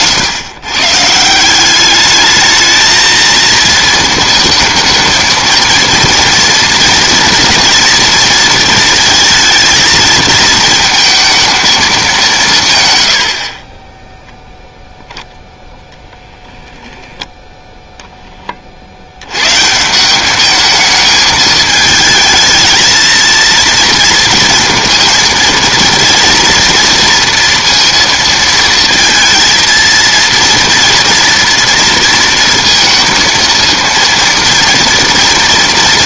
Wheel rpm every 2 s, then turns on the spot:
140, 220, 220, 230, 220, 230, 140, 0, 10, 50, 210, 230, 230, 230, 230, 230, 230, 230.
none